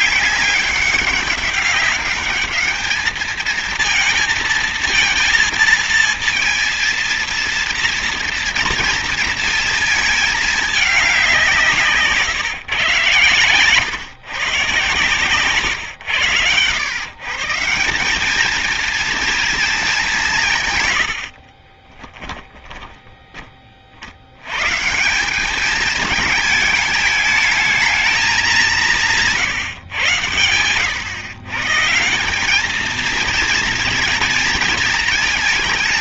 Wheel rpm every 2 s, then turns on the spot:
200, 210, 230, 230, 230, 210, 140, 130, 120, 220, 140, 10, 120, 220, 200, 110, 210, 230.
22-24